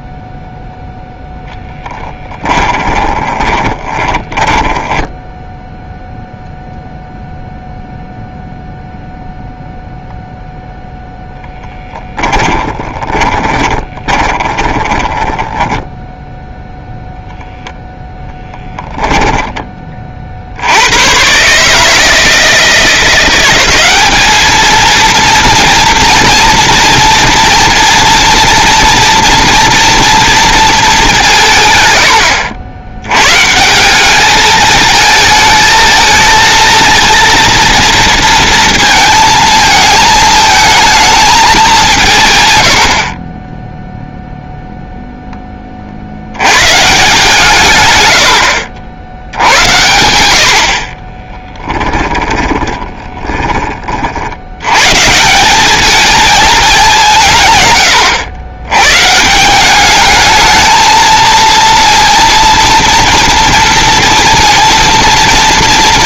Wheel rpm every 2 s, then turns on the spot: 0, 20, 10, 0, 0, 0, 20, 20, 0, 10, 80, 170, 230, 230, 230, 210, 90, 220, 230, 230, 220, 90, 0, 140, 70, 40, 20, 120, 200, 120, 230, 230, 230.
2-6 12-16 18-20 50-54